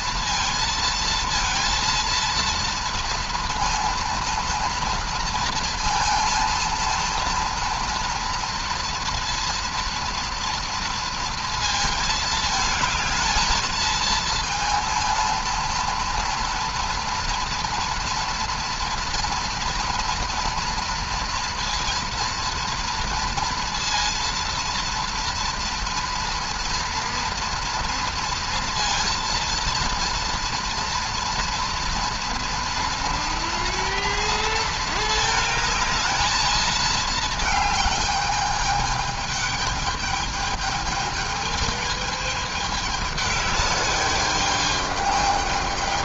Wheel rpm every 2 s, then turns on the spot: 230, 230, 230, 230, 230, 230, 220, 230, 230, 230, 230, 230, 230, 230, 230, 230, 240, 220, 220, 210, 220, 210, 210.
none